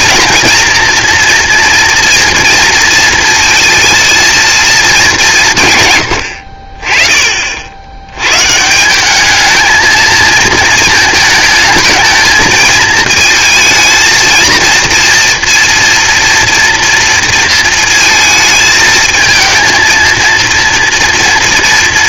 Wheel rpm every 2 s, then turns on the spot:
230, 230, 220, 40, 160, 230, 220, 230, 230, 220, 230.
none